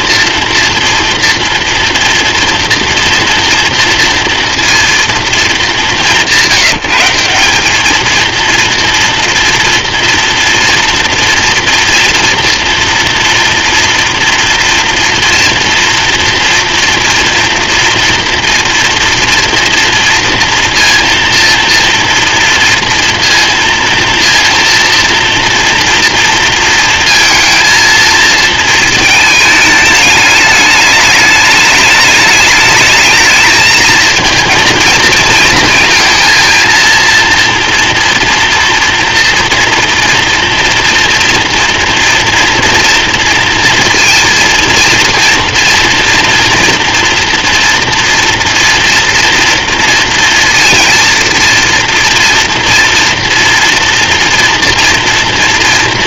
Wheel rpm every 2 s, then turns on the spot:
230, 230, 230, 180, 230, 230, 230, 230, 240, 230, 230, 230, 230, 230, 220, 210, 220, 230, 230, 230, 230, 230, 230, 230, 230, 230, 230, 230.
none